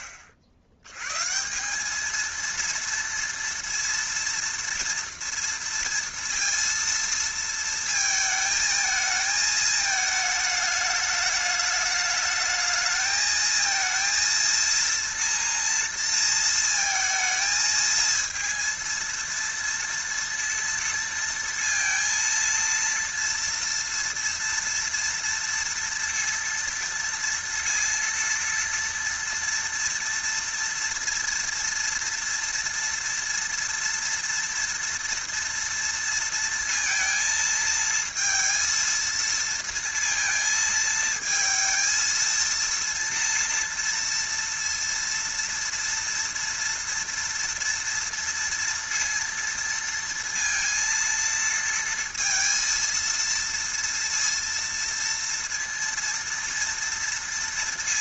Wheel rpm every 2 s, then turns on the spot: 70, 230, 230, 230, 220, 210, 220, 230, 230, 230, 230, 230, 230, 230, 230, 230, 230, 230, 230, 230, 220, 230, 230, 230, 230, 230, 230, 230, 230.
none